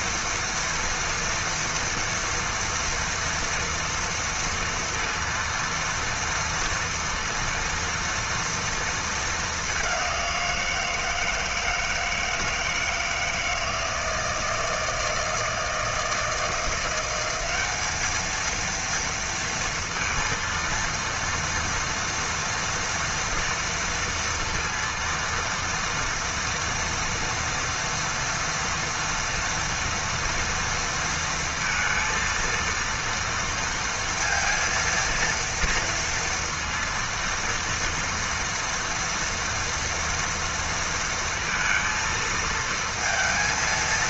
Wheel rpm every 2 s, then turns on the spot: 230, 240, 230, 230, 220, 160, 160, 160, 180, 230, 230, 230, 230, 230, 230, 230, 230, 230, 230, 230, 230, 230.
none